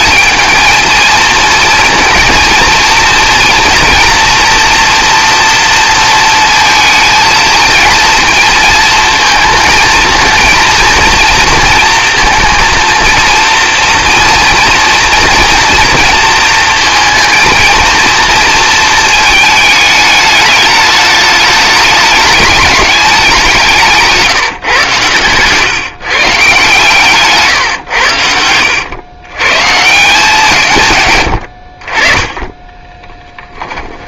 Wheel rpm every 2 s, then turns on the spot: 220, 230, 240, 220, 220, 230, 230, 230, 230, 230, 210, 210, 130, 140, 90, 140, 10.
32-34